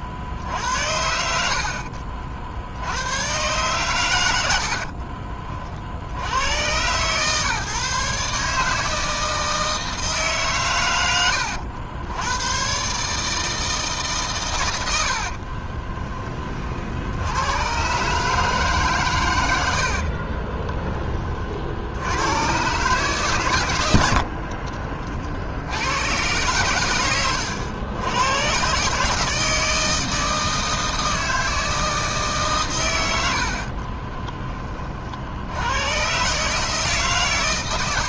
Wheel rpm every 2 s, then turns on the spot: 70, 60, 70, 110, 150, 130, 120, 110, 40, 140, 30, 120, 50, 110, 120, 160, 140, 30, 150.
20-22 24-26